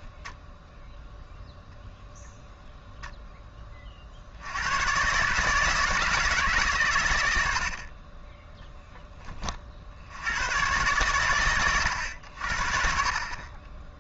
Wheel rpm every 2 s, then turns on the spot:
0, 0, 100, 140, 0, 90, 60.
none